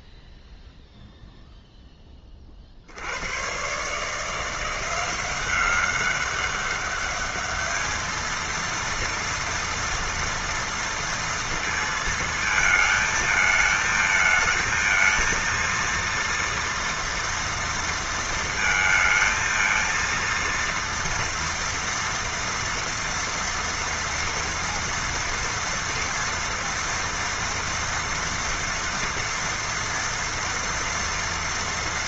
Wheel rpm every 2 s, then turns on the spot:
0, 20, 160, 200, 220, 240, 220, 220, 230, 230, 230, 230, 230, 230, 230, 230.
none